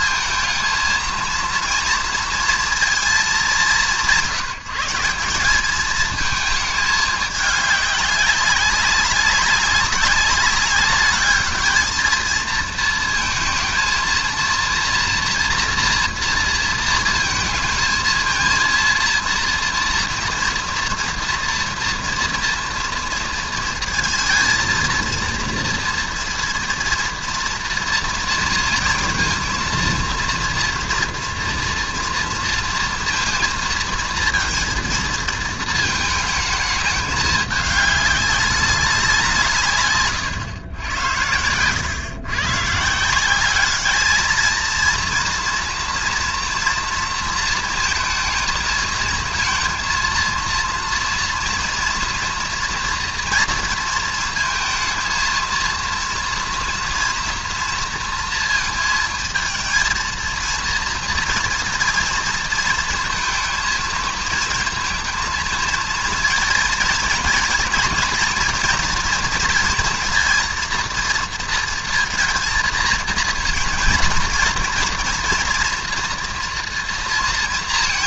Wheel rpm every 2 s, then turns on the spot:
230, 230, 190, 220, 200, 200, 220, 230, 230, 230, 230, 230, 220, 230, 230, 230, 230, 230, 220, 200, 130, 130, 220, 240, 220, 230, 230, 230, 230, 230, 230, 230, 220, 230, 230, 230, 230, 230, 240.
none